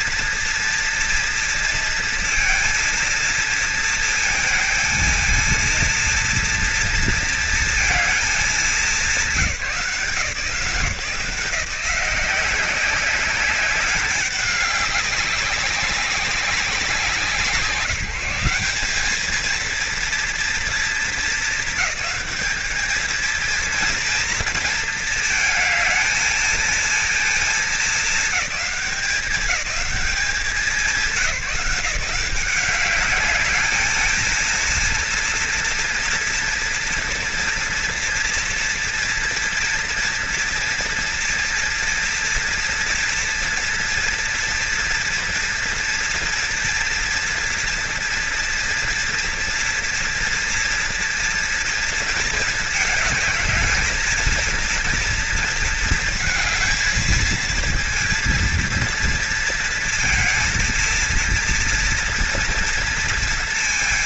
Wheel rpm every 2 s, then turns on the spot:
240, 230, 220, 230, 190, 160, 190, 190, 190, 210, 220, 220, 230, 220, 200, 200, 200, 230, 230, 230, 230, 230, 230, 230, 230, 230, 220, 230, 230, 230, 230, 230.
none